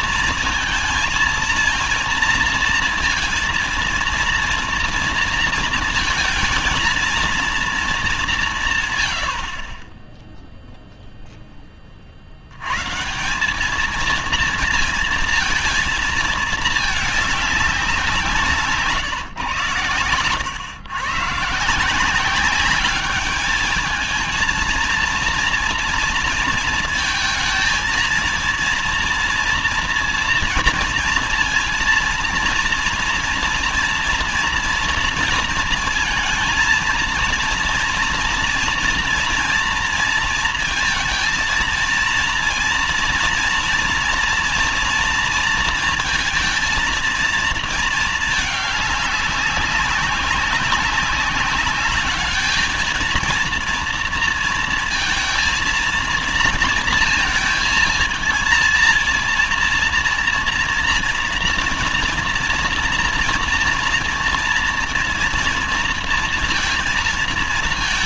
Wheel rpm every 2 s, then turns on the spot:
230, 230, 230, 230, 160, 0, 110, 230, 220, 160, 110, 200, 230, 230, 230, 230, 230, 230, 220, 240, 230, 230, 230, 230, 210, 190, 220, 230, 230, 230, 230, 230, 230, 230.
none